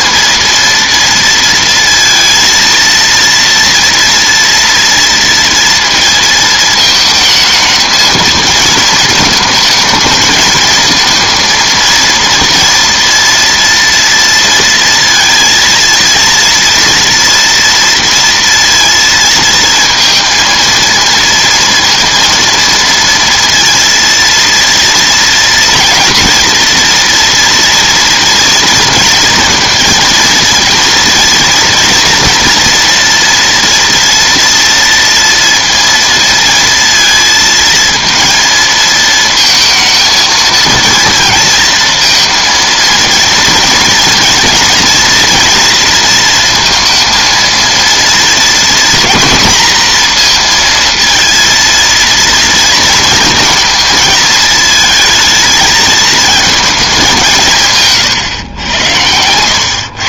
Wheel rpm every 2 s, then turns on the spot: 230, 230, 240, 220, 230, 220, 230, 230, 230, 230, 230, 230, 230, 230, 230, 230, 240, 230, 230, 220, 230, 230, 230, 230, 230, 230, 230, 220, 220, 110.
none